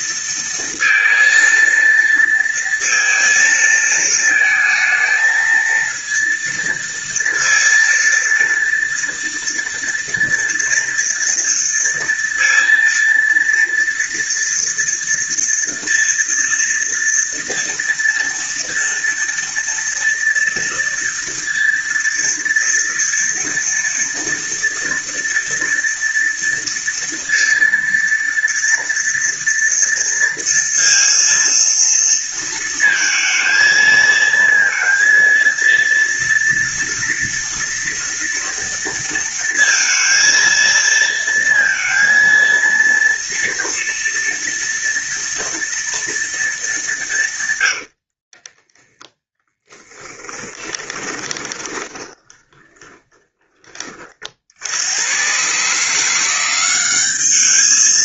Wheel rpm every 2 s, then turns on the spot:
230, 230, 220, 230, 230, 230, 230, 230, 230, 230, 230, 230, 230, 230, 230, 230, 230, 230, 230, 230, 230, 230, 230, 220, 10, 20, 20, 80, 190.
48-54